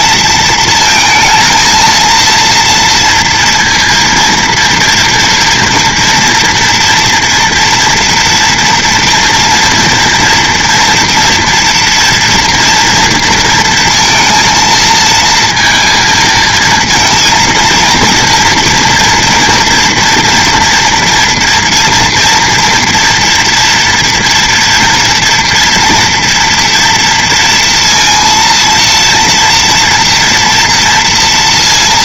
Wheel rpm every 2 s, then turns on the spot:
230, 230, 230, 230, 230, 230, 240, 230, 230, 230, 230, 230, 230, 230, 230, 240.
none